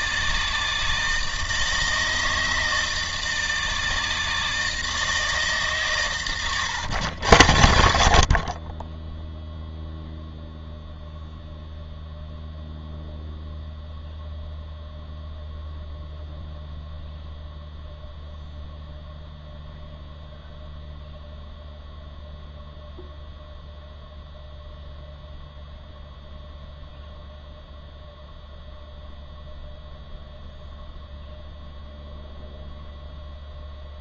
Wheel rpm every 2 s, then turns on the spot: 160, 160, 160, 120, 30, 0, 0, 0, 0, 0, 0, 0, 0, 0, 0, 0, 0.
none